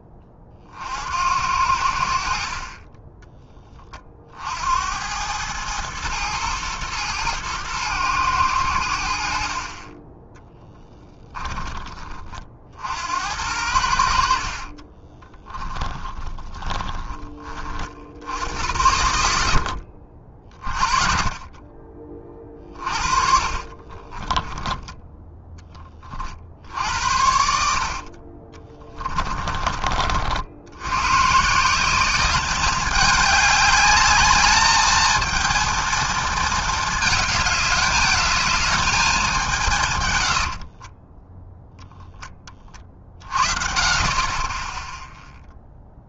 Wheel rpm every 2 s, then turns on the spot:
40, 30, 70, 110, 100, 10, 60, 40, 20, 80, 40, 30, 10, 60, 30, 90, 200, 220, 220, 220, 50, 30, 10.
10-12 14-18 22-26 28-30 40-42